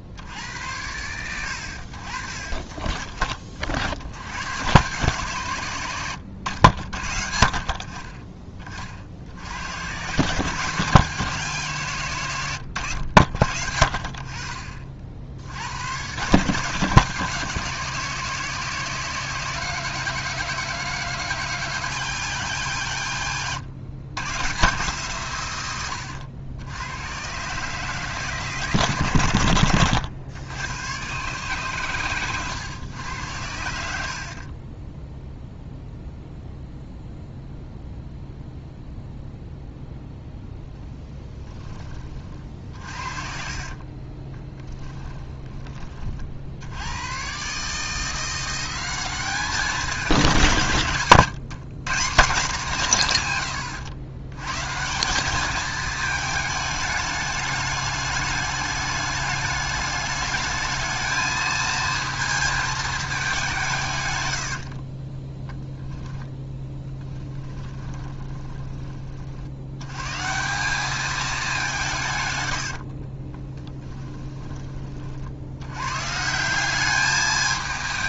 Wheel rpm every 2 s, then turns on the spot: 90, 30, 120, 70, 30, 150, 90, 50, 140, 160, 160, 130, 140, 100, 130, 110, 110, 20, 0, 0, 0, 40, 20, 80, 190, 150, 180, 160, 210, 210, 220, 220, 50, 10, 30, 200, 80, 30, 200.
34-36 42-46 64-68 72-74